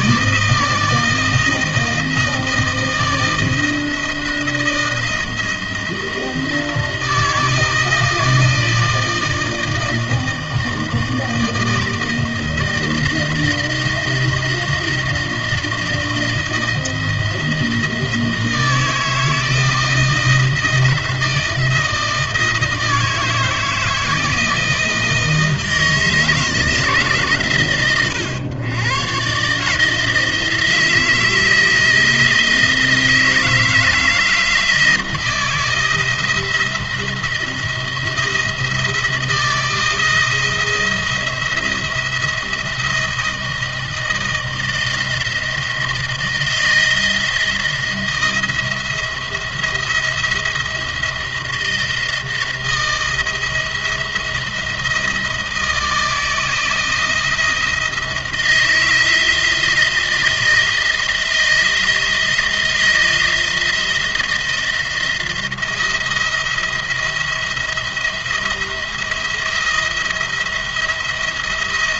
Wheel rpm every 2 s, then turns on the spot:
160, 160, 160, 160, 160, 160, 160, 170, 160, 160, 160, 160, 160, 150, 120, 160, 160, 160, 170, 170, 170, 160, 160, 170, 160, 170, 160, 160, 170, 160, 160, 160, 170, 170, 170, 170.
none